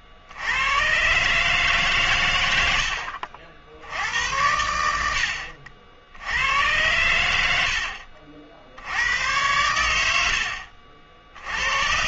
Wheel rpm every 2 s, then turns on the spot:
90, 90, 80, 80, 70, 50.
none